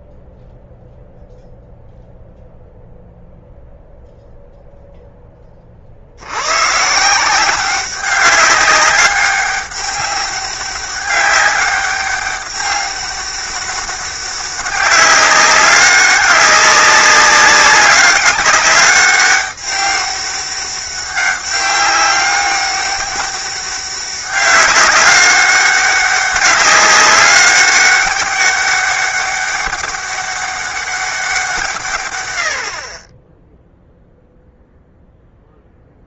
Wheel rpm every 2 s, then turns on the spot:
0, 0, 0, 140, 200, 200, 200, 200, 200, 200, 200, 200, 200, 190, 200, 200, 50, 0.
none